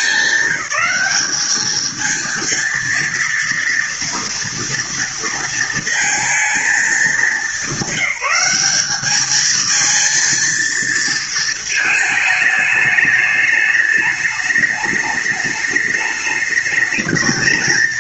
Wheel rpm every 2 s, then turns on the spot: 200, 230, 230, 220, 210, 230, 210, 210, 210.
none